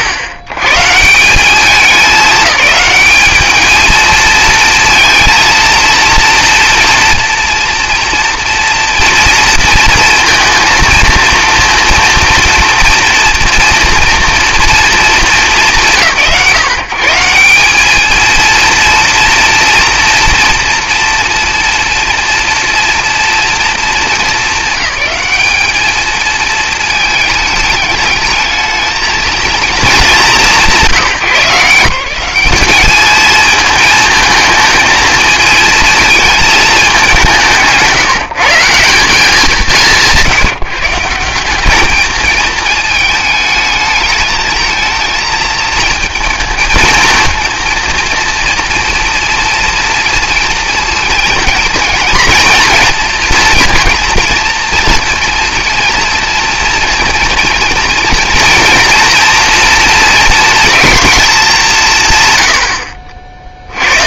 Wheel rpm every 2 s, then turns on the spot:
100, 210, 230, 230, 230, 230, 230, 240, 120, 230, 230, 230, 190, 220, 220, 150, 210, 220, 210, 180, 150, 210, 220, 230, 240, 230, 230, 230, 240, 240, 220, 50.
none